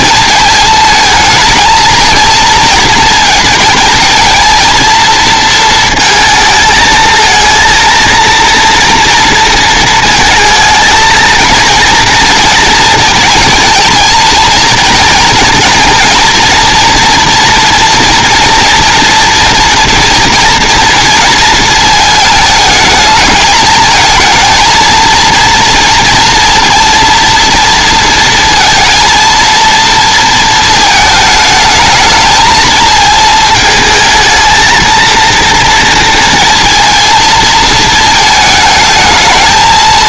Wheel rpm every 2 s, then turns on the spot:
220, 230, 230, 220, 230, 230, 230, 230, 230, 230, 230, 220, 230, 230, 230, 220, 220, 220, 220, 220.
none